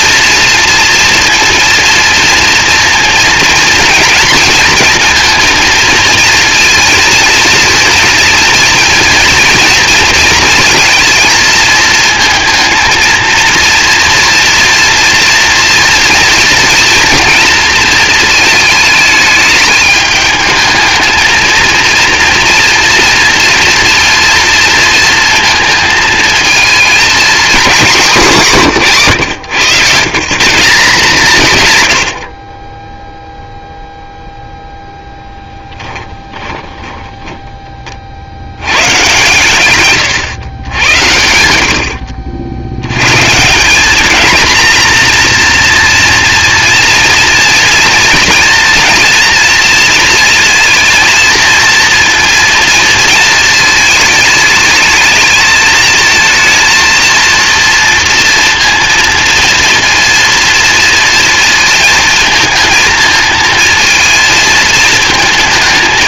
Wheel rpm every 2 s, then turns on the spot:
230, 230, 230, 230, 230, 230, 220, 240, 230, 220, 220, 240, 230, 230, 170, 160, 10, 0, 30, 110, 100, 90, 230, 230, 230, 230, 230, 210, 230, 230, 230, 220, 220.
36-38